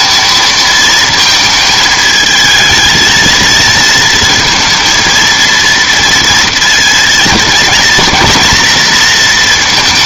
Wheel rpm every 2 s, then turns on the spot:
220, 220, 230, 230, 230.
none